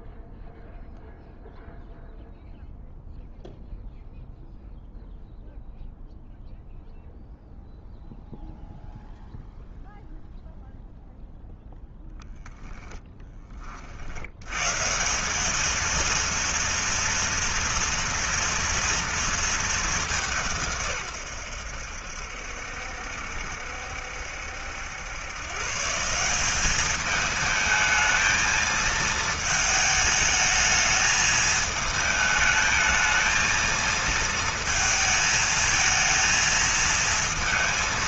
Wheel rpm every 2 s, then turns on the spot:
0, 0, 0, 0, 0, 0, 0, 130, 230, 230, 140, 70, 90, 200, 220, 210, 220, 220, 230.
none